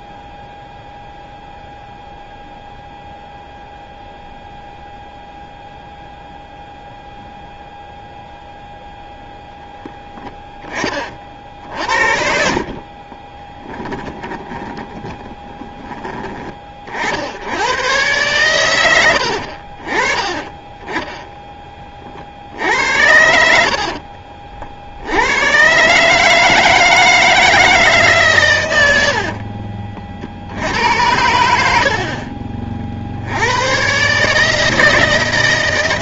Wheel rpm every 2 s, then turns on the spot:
0, 0, 0, 0, 0, 20, 50, 30, 40, 110, 20, 60, 60, 160, 100, 80, 50, 160.
12-16